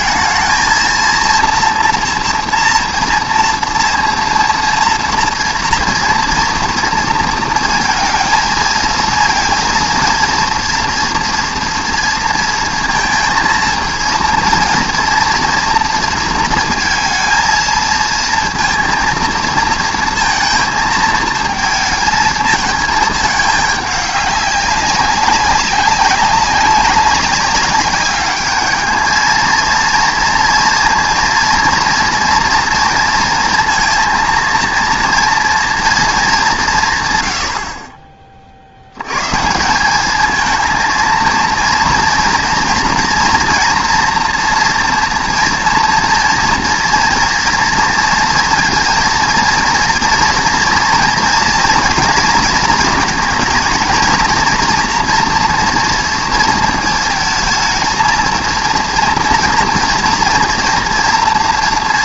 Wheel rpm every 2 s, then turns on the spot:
220, 230, 230, 230, 220, 230, 230, 230, 230, 230, 230, 220, 200, 190, 210, 230, 230, 230, 180, 60, 220, 230, 230, 230, 230, 240, 220, 230, 230, 230, 230.
none